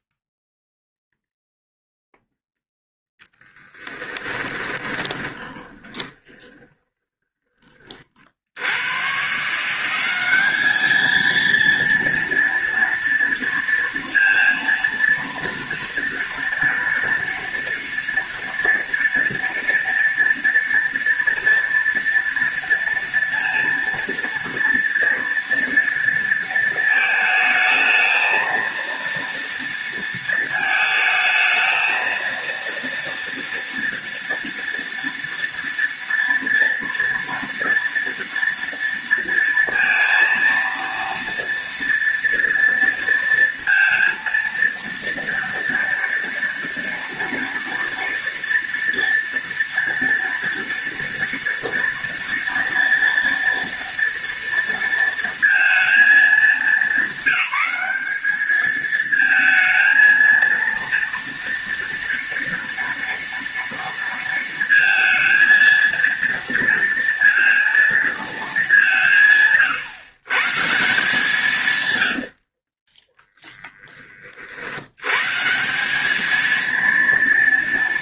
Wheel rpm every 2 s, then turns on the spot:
0, 0, 20, 20, 120, 220, 230, 230, 230, 230, 230, 230, 230, 220, 230, 220, 230, 230, 230, 230, 230, 230, 230, 230, 230, 240, 230, 230, 210, 220, 230, 230, 230, 230, 180, 160, 20, 100, 230.
4-8 72-74